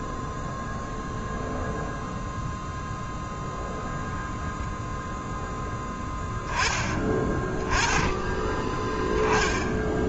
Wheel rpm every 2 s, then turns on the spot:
0, 0, 0, 10, 10.
none